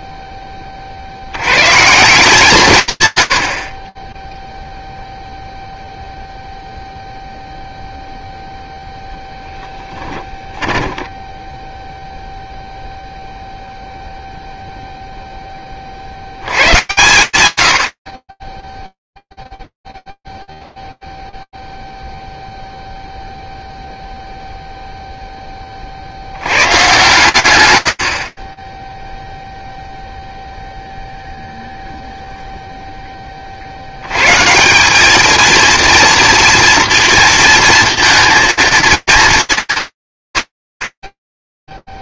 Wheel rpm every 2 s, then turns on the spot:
20, 170, 0, 0, 0, 10, 0, 20, 170, 0, 0, 0, 0, 110, 10, 0, 20, 210, 230, 230, 120.
10-12